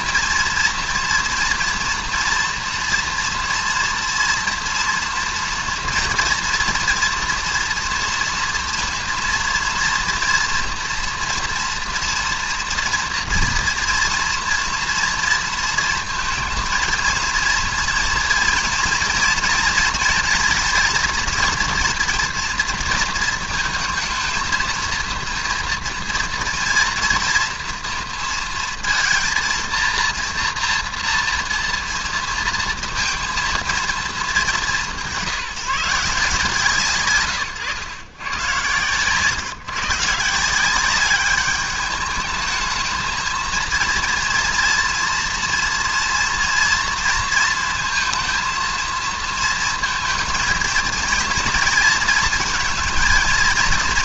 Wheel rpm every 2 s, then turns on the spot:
230, 230, 240, 230, 230, 230, 230, 240, 230, 230, 230, 230, 230, 230, 230, 230, 230, 180, 130, 130, 180, 220, 230, 230, 230, 230, 230.
none